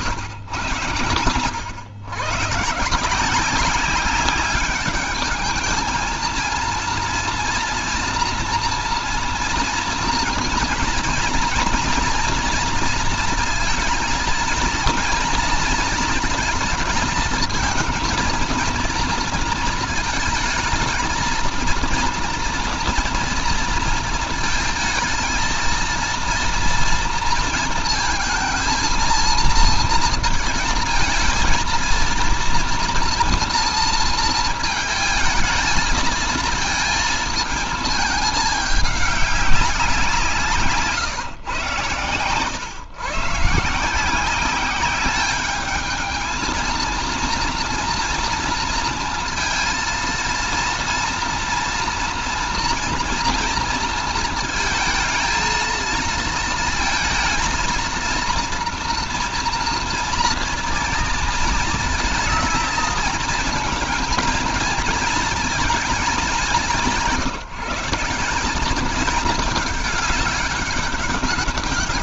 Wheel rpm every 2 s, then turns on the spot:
110, 140, 200, 230, 230, 230, 230, 230, 230, 230, 220, 230, 220, 230, 230, 230, 230, 220, 230, 210, 160, 130, 190, 230, 230, 230, 230, 220, 230, 230, 230, 220, 230, 180, 200, 200.
none